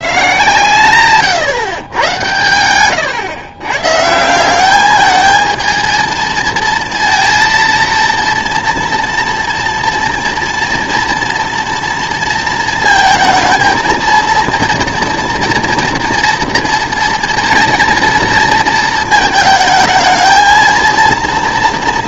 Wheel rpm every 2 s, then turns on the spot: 120, 110, 190, 230, 230, 230, 230, 230, 240, 230, 220.
none